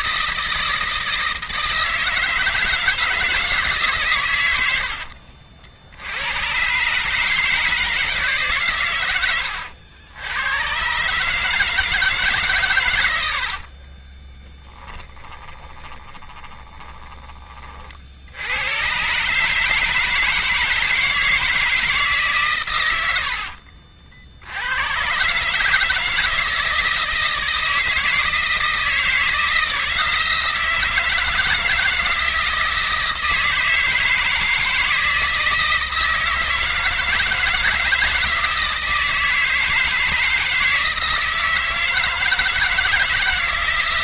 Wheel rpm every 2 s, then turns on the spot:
160, 160, 60, 150, 100, 130, 90, 20, 20, 120, 160, 90, 130, 170, 160, 160, 160, 160, 160, 160, 160, 160.
12-16 22-24